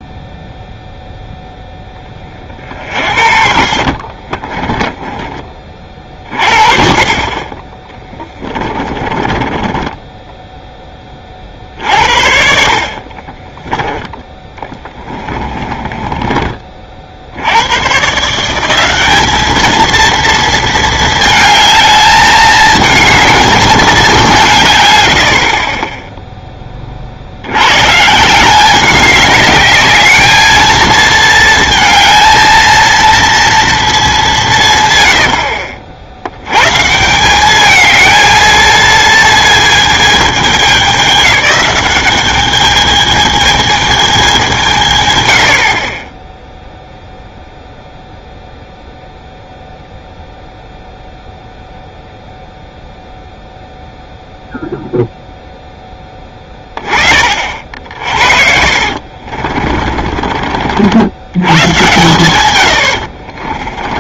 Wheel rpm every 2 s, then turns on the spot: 0, 40, 30, 40, 20, 10, 70, 20, 30, 170, 230, 210, 140, 10, 180, 220, 220, 150, 130, 220, 210, 210, 190, 0, 0, 0, 0, 0, 20, 60, 50, 100.
4-6 8-10 12-16 58-60 62-64